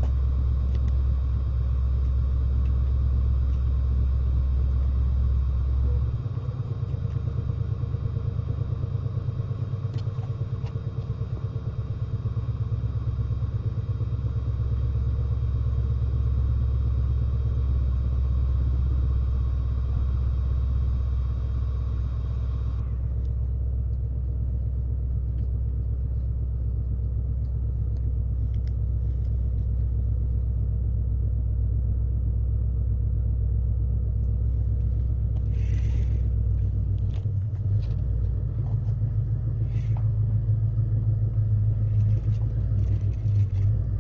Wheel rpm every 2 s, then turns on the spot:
0, 0, 0, 0, 0, 0, 0, 0, 0, 0, 0, 0, 0, 0, 0, 0, 0, 0, 0, 0, 0, 0.
none